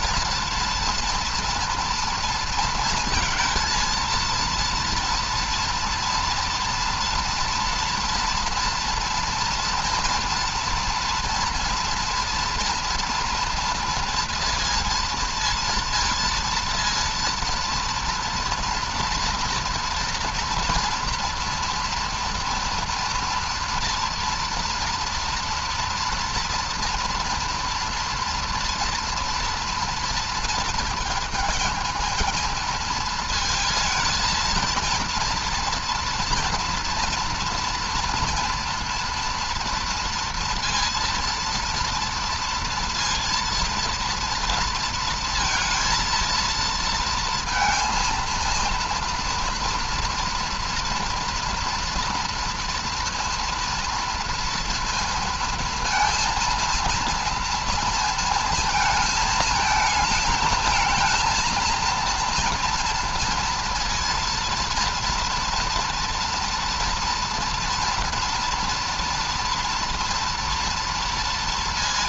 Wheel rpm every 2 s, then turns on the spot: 230, 230, 230, 230, 240, 240, 230, 230, 230, 230, 230, 230, 230, 230, 230, 230, 220, 230, 230, 230, 230, 230, 230, 230, 230, 230, 230, 230, 230, 220, 220, 230, 230, 240, 230, 230.
none